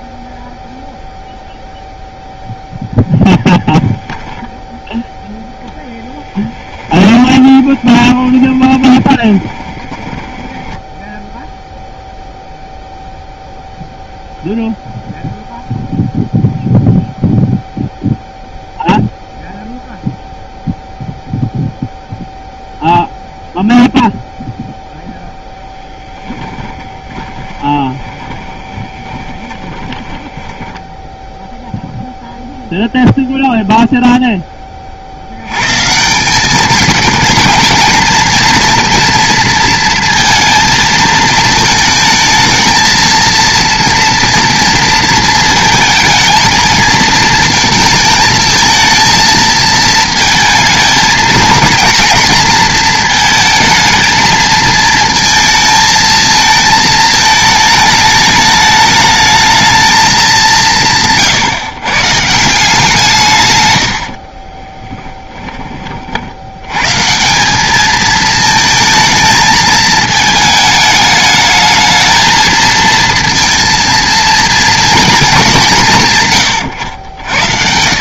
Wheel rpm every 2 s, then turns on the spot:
0, 0, 0, 20, 20, 10, 0, 0, 0, 0, 0, 0, 0, 20, 10, 10, 0, 30, 210, 230, 220, 220, 230, 230, 220, 230, 230, 220, 220, 210, 150, 160, 10, 130, 220, 220, 220, 220, 80.
6-12 26-30 64-66 76-78